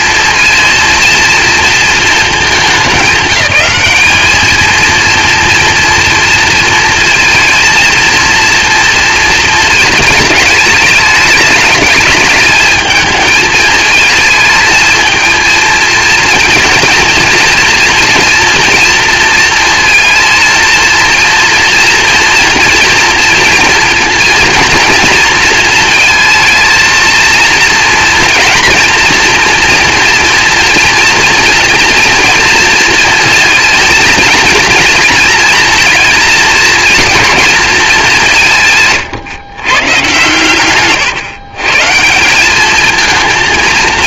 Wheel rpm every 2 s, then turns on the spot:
230, 200, 220, 230, 230, 210, 220, 220, 230, 240, 230, 230, 230, 220, 230, 230, 230, 230, 230, 170, 130, 200.
none